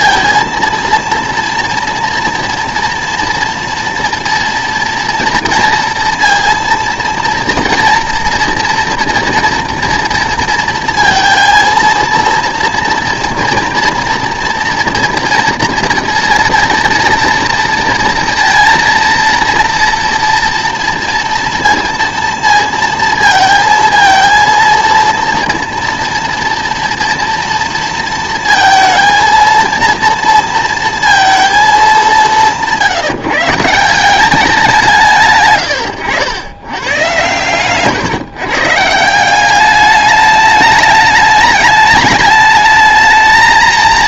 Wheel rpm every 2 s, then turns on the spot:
230, 230, 230, 230, 230, 230, 230, 240, 230, 230, 230, 230, 230, 230, 230, 230, 180, 180, 100, 140, 210, 210.
none